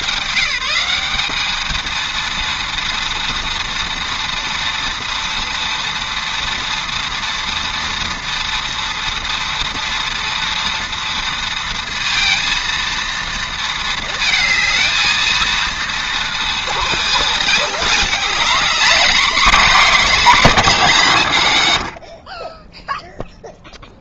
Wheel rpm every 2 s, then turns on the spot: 190, 230, 240, 230, 230, 230, 230, 220, 230, 240, 220, 10.
22-24